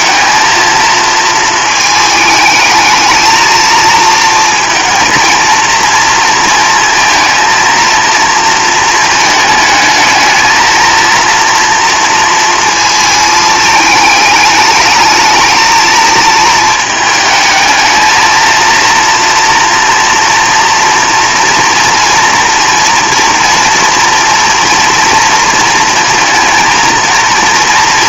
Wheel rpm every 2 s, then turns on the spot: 230, 220, 230, 230, 230, 220, 230, 210, 220, 230, 230, 240, 240, 230.
none